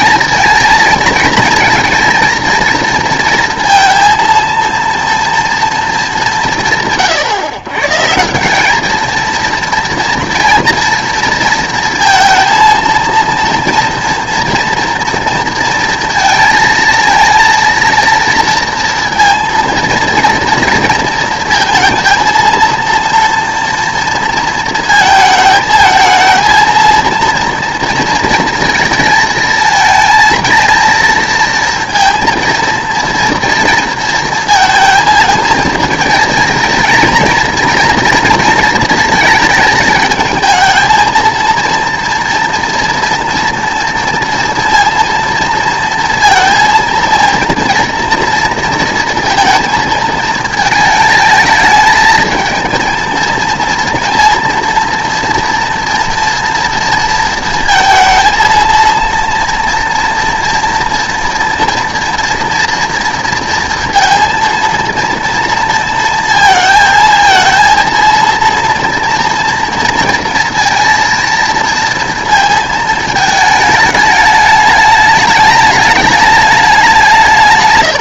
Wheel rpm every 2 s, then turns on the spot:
230, 230, 230, 170, 200, 230, 220, 240, 230, 230, 230, 230, 220, 230, 230, 220, 230, 230, 230, 230, 220, 240, 230, 230, 230, 220, 220, 230, 230, 230, 230, 230, 230, 220, 230, 230, 220, 210, 200.
none